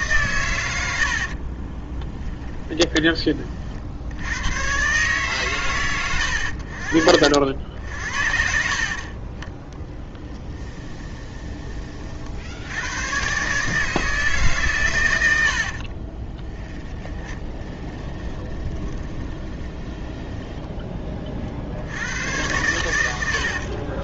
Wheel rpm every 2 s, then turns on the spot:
80, 10, 130, 60, 50, 20, 90, 130, 20, 20, 20, 100.
0-2 10-12 16-20